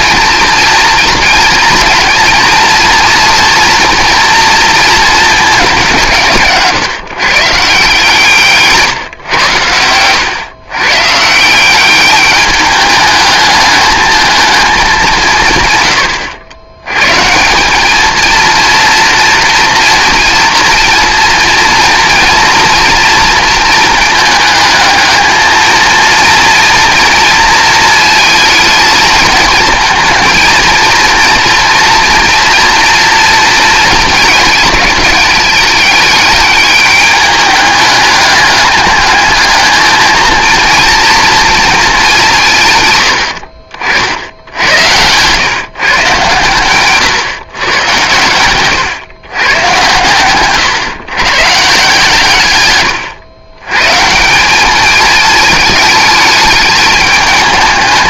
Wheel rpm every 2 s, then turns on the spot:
230, 230, 230, 160, 150, 130, 210, 210, 100, 230, 230, 230, 220, 230, 230, 230, 230, 210, 210, 210, 230, 150, 90, 130, 120, 130, 110, 200, 210.
52-54